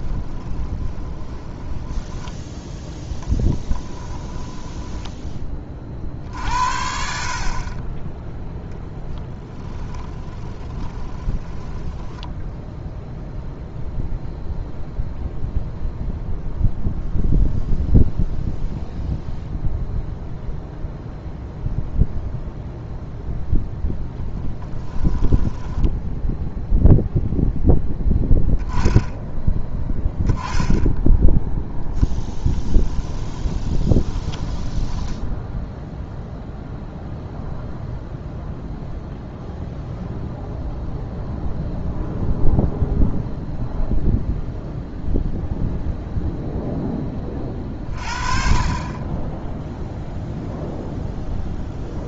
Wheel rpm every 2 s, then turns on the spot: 20, 10, 10, 60, 10, 10, 0, 0, 0, 0, 0, 0, 10, 0, 10, 10, 10, 10, 0, 0, 0, 0, 0, 10, 30, 0.
0-2 4-6 10-12 24-26 32-36